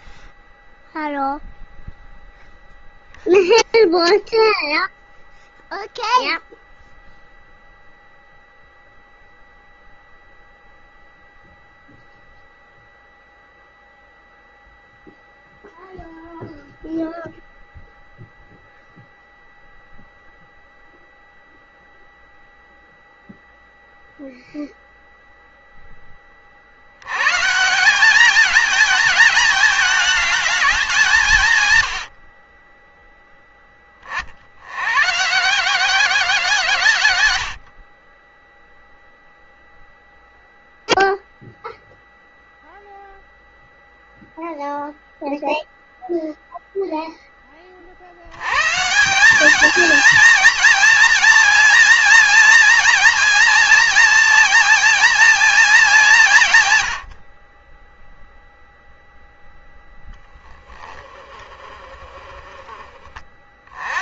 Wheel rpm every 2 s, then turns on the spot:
0, 0, 0, 0, 0, 0, 0, 0, 0, 0, 0, 0, 0, 40, 220, 210, 40, 70, 150, 10, 0, 0, 0, 0, 110, 230, 230, 230, 170, 0, 10, 20.
none